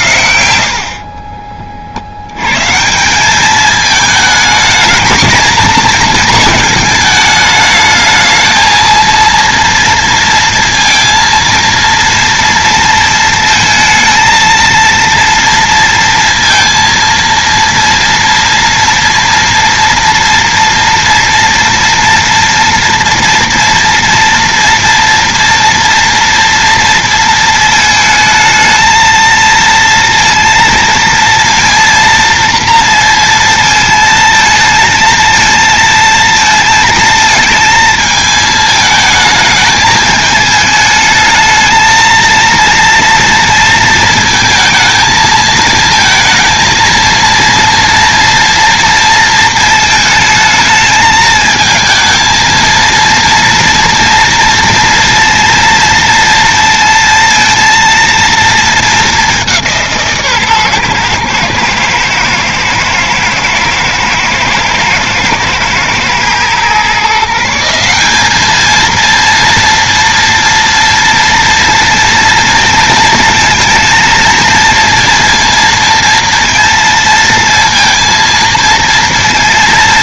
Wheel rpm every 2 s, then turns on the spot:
70, 140, 220, 230, 220, 230, 230, 230, 230, 230, 230, 230, 230, 230, 220, 230, 230, 220, 230, 220, 220, 230, 220, 230, 230, 220, 230, 230, 230, 220, 130, 110, 110, 120, 220, 230, 230, 230, 230, 230.
none